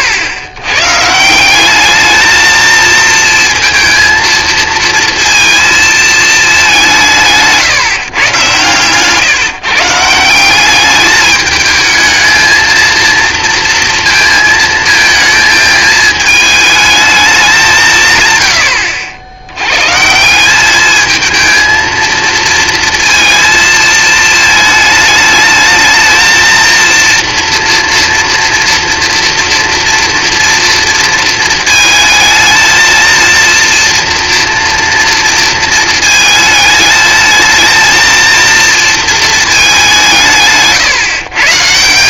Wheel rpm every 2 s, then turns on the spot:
120, 220, 230, 200, 130, 190, 220, 230, 220, 100, 200, 230, 220, 230, 230, 230, 230, 230, 220, 230, 150.
none